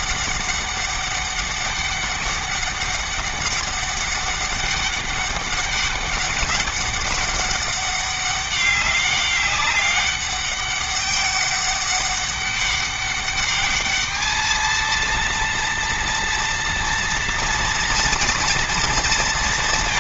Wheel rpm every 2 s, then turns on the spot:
200, 200, 200, 200, 200, 200, 200, 220, 230, 230.
none